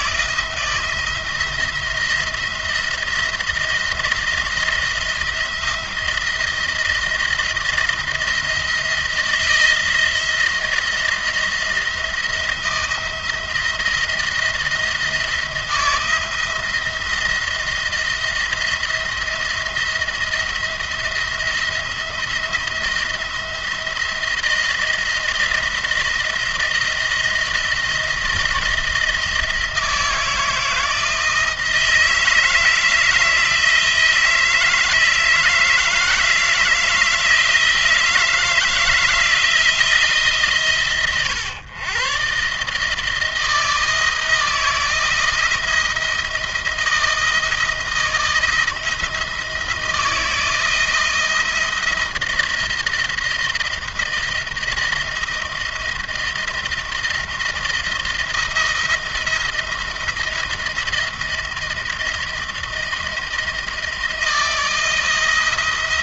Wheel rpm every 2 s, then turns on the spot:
170, 170, 170, 170, 170, 170, 170, 170, 170, 170, 170, 170, 160, 170, 170, 160, 160, 160, 160, 160, 140, 150, 170, 170, 170, 170, 170, 170, 170, 170, 170, 170, 170.
none